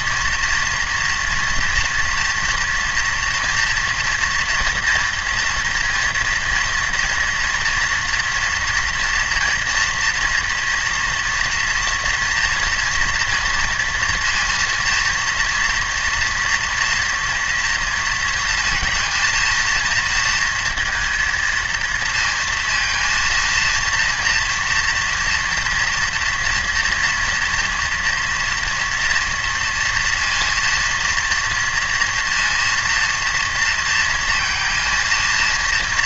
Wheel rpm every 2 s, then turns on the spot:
230, 230, 230, 230, 230, 230, 230, 230, 230, 230, 230, 230, 230, 240, 230, 230, 230, 230.
none